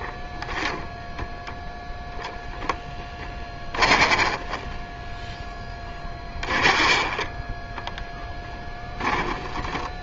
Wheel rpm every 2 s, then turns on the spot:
0, 0, 10, 20, 10.
6-8